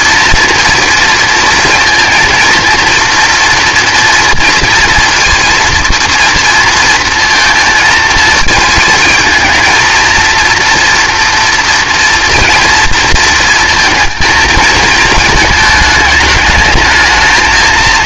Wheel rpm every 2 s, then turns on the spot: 230, 230, 230, 230, 220, 230, 230, 230, 220.
none